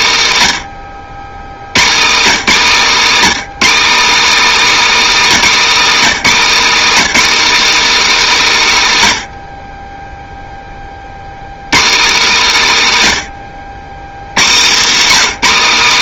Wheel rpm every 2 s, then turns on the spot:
160, 220, 290, 250, 250, 10, 220, 160.
none